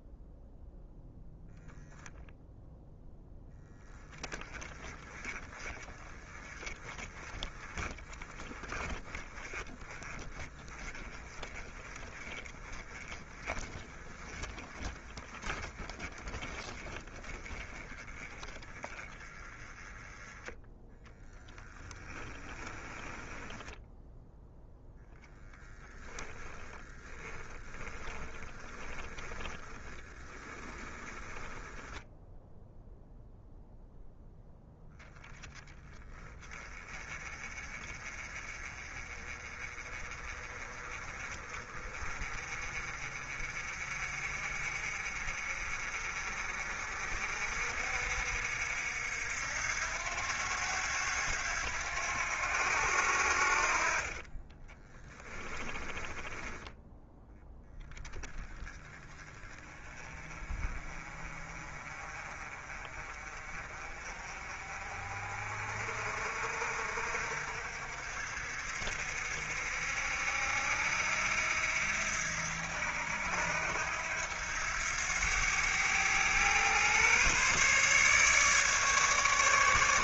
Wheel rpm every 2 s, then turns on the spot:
0, 0, 20, 20, 20, 20, 20, 20, 20, 20, 10, 10, 0, 10, 10, 10, 0, 0, 20, 30, 30, 40, 50, 50, 70, 90, 80, 10, 10, 20, 30, 40, 50, 60, 60, 80, 80, 90, 130, 150.
22-24 26-32 54-56